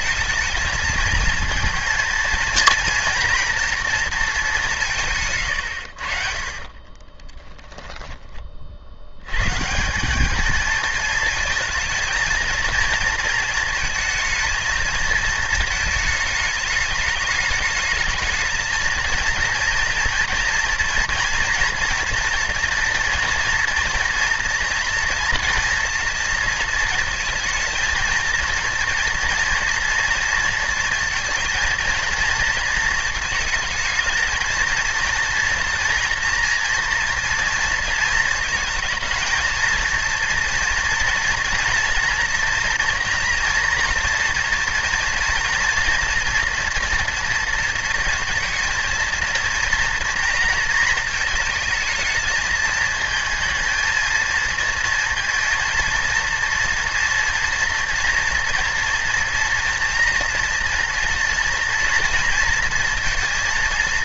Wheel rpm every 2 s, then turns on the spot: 220, 230, 170, 30, 70, 220, 230, 230, 210, 230, 230, 230, 230, 220, 230, 230, 230, 230, 230, 220, 230, 230, 230, 230, 230, 230, 220, 230, 230, 230, 240, 230.
6-8